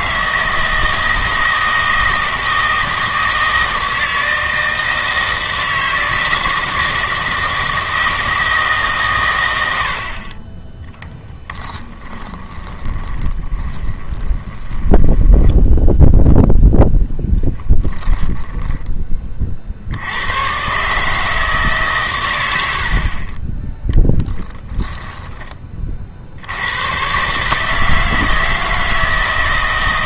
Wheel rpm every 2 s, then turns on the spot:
160, 160, 160, 160, 140, 10, 20, 10, 10, 10, 130, 70, 10, 100, 160.
12-16